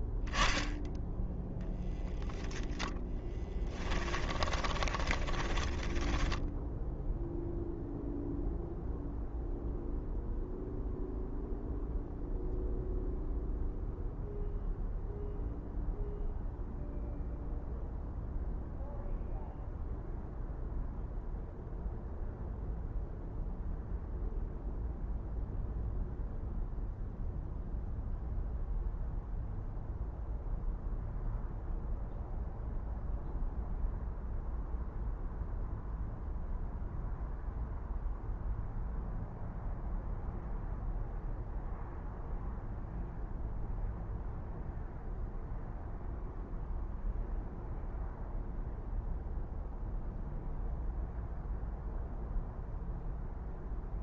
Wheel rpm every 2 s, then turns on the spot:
0, 0, 30, 0, 0, 0, 0, 0, 0, 0, 0, 0, 0, 0, 0, 0, 0, 0, 0, 0, 0, 0, 0, 0, 0, 0, 0.
4-6